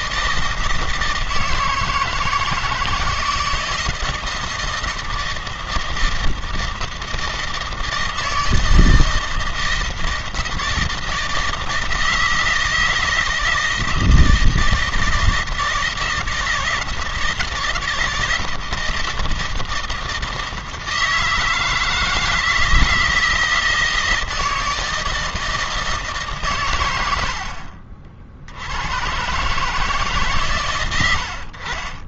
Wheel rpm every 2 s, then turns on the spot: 160, 160, 160, 160, 160, 160, 160, 160, 160, 160, 160, 160, 160, 120, 80, 120.
none